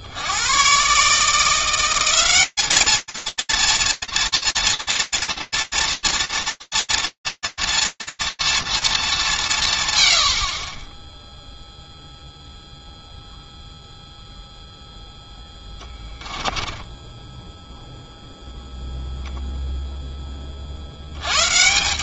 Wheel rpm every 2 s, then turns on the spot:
90, 200, 240, 240, 240, 110, 0, 0, 10, 0, 110.
16-18